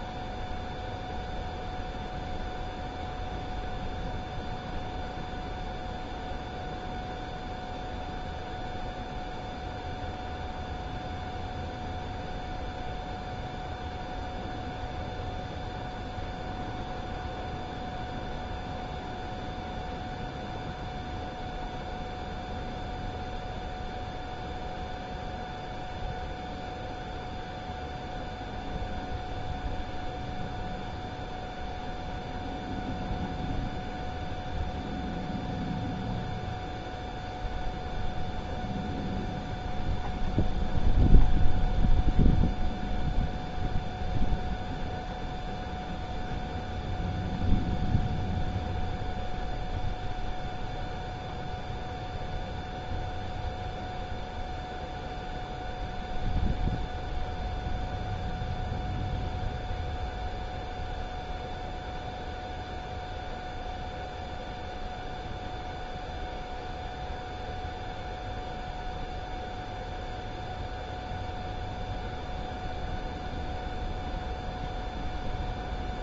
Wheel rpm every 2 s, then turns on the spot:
0, 0, 0, 0, 0, 0, 0, 0, 0, 0, 0, 0, 0, 0, 0, 0, 0, 0, 0, 0, 0, 0, 0, 0, 0, 0, 0, 0, 0, 0, 0, 0, 0, 0, 0, 0, 0, 0.
none